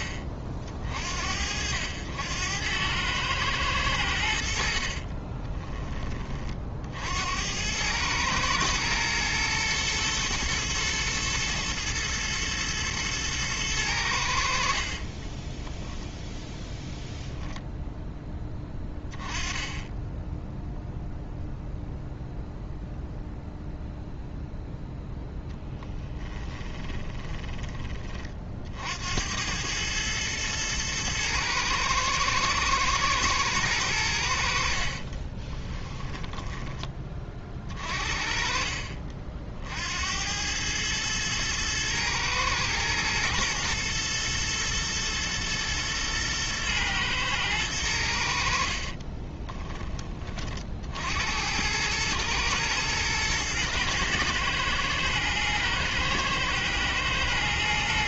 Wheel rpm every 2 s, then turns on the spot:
50, 100, 60, 60, 110, 120, 110, 50, 10, 20, 0, 0, 0, 20, 60, 110, 110, 50, 20, 40, 110, 110, 120, 110, 50, 60, 110, 110, 110.
4-6 14-16 26-28 34-36 48-50